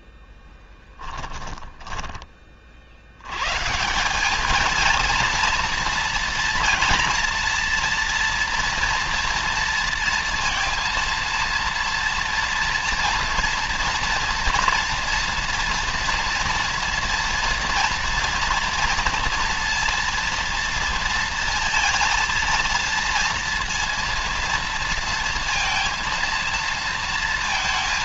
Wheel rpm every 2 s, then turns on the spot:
10, 60, 220, 230, 230, 230, 230, 230, 230, 230, 230, 230, 230, 230.
0-2